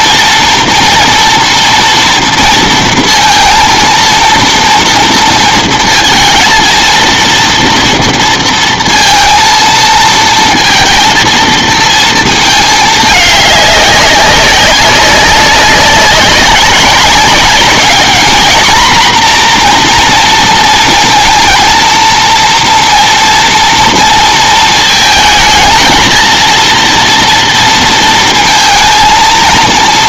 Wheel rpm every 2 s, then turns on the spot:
230, 230, 230, 220, 230, 230, 220, 190, 200, 230, 230, 230, 230, 230, 230.
none